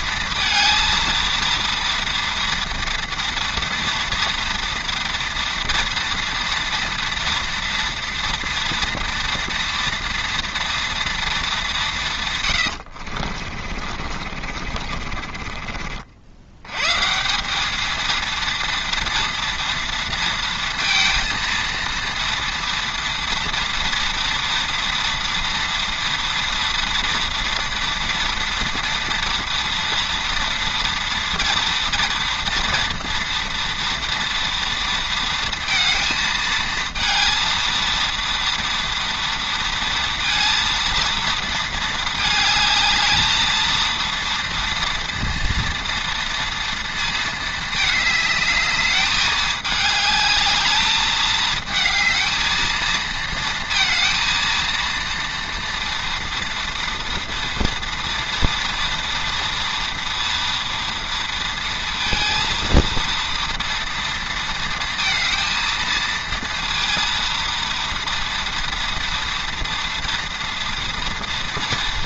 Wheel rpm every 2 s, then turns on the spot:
230, 230, 240, 230, 230, 230, 100, 50, 90, 230, 230, 230, 230, 230, 230, 230, 230, 230, 230, 230, 230, 220, 230, 230, 210, 210, 220, 230, 230, 230, 230, 230, 230, 230, 230, 230.
12-16